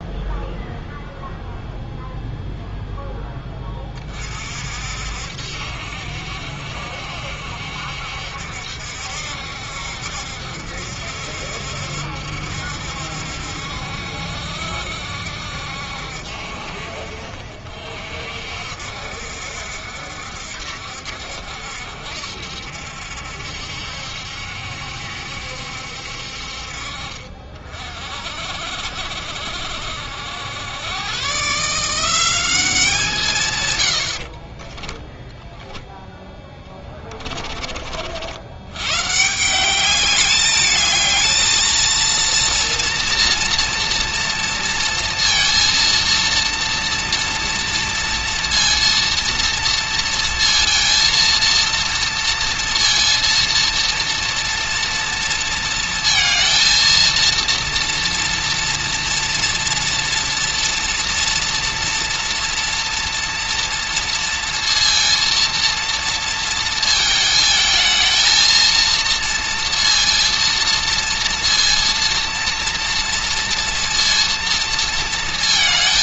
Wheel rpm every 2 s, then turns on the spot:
0, 0, 60, 70, 70, 70, 70, 70, 60, 60, 60, 70, 70, 50, 60, 100, 180, 10, 20, 110, 210, 230, 230, 230, 230, 230, 230, 230, 220, 230, 230, 230, 230, 220, 230, 230, 230, 230.
34-38